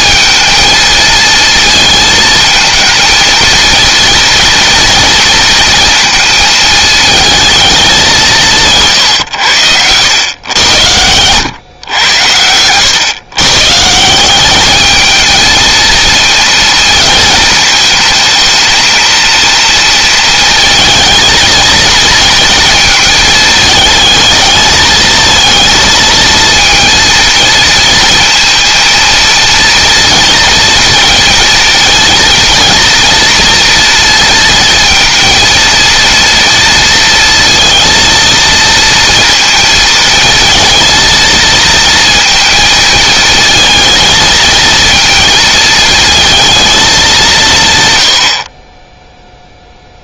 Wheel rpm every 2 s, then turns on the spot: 230, 230, 230, 220, 140, 100, 120, 210, 230, 230, 220, 220, 220, 230, 230, 230, 230, 230, 230, 230, 230, 230, 230, 200, 20.
none